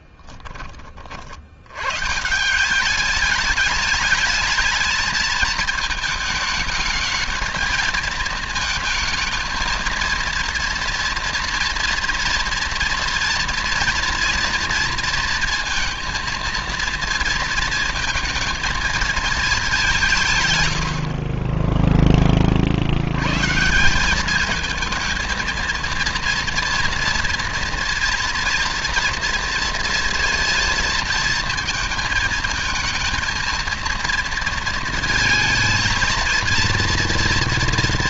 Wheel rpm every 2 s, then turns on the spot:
30, 200, 220, 220, 220, 230, 230, 230, 230, 230, 80, 80, 220, 230, 230, 220, 230, 230, 230.
none